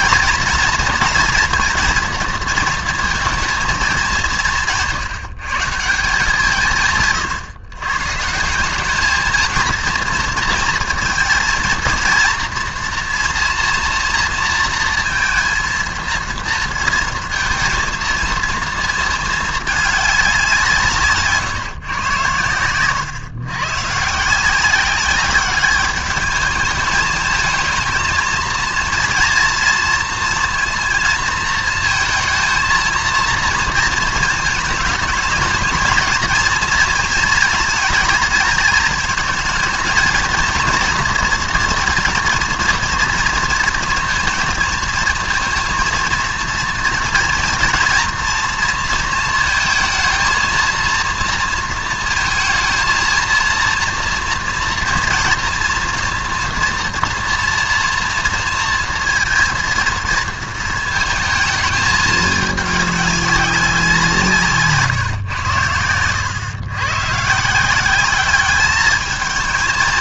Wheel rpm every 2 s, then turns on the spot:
230, 230, 170, 160, 200, 230, 230, 230, 230, 220, 160, 110, 190, 210, 230, 230, 230, 220, 230, 220, 240, 230, 230, 230, 230, 230, 220, 230, 230, 230, 220, 200, 140, 120, 210.
none